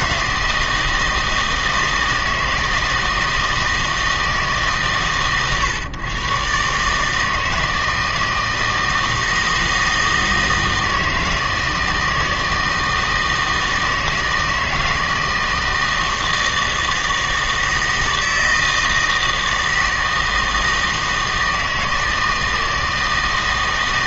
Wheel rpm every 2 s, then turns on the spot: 160, 160, 140, 130, 160, 160, 160, 160, 160, 160, 160, 160.
none